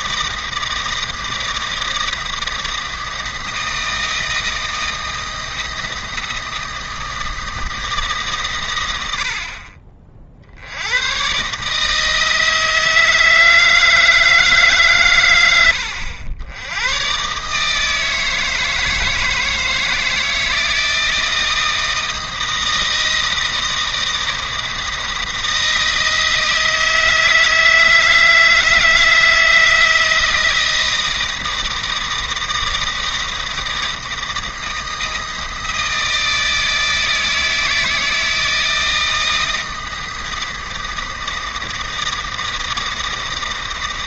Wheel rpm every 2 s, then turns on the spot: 160, 160, 160, 160, 110, 90, 160, 140, 100, 160, 160, 160, 160, 160, 160, 160, 160, 160, 160, 160, 160, 160.
none